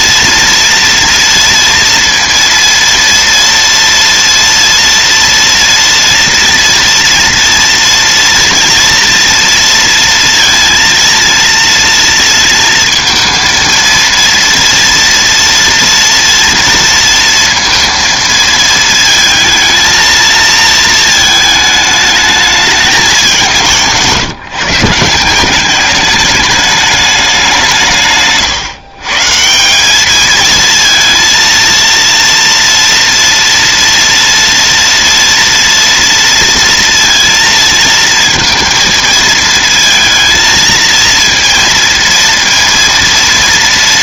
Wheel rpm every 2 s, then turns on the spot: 230, 230, 230, 230, 230, 230, 230, 230, 230, 220, 230, 210, 160, 210, 140, 220, 230, 230, 230, 230, 230, 230.
none